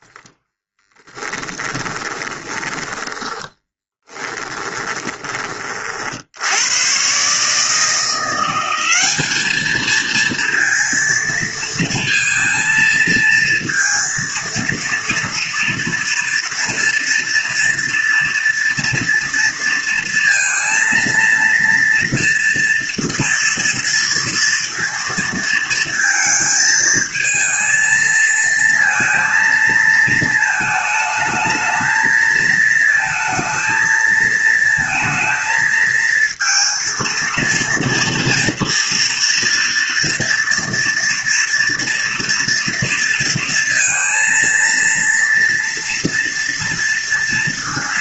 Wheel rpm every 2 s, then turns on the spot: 20, 10, 20, 140, 210, 230, 230, 230, 230, 230, 230, 230, 230, 220, 230, 220, 220, 230, 230, 230, 240, 230, 230, 230.
0-4